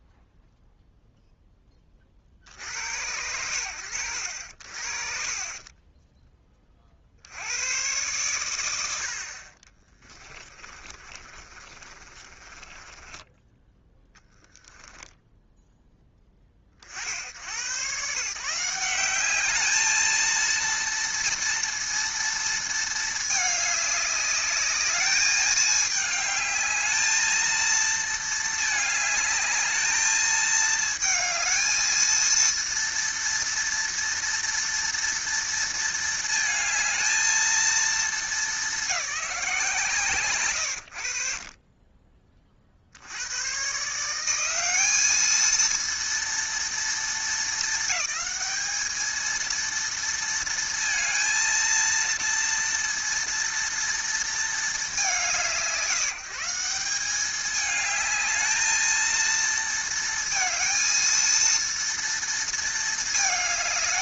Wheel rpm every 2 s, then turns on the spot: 0, 40, 50, 40, 100, 30, 20, 0, 40, 180, 230, 220, 210, 220, 220, 220, 230, 230, 220, 200, 70, 60, 200, 230, 220, 230, 230, 220, 170, 220, 220, 220.
4-6 10-14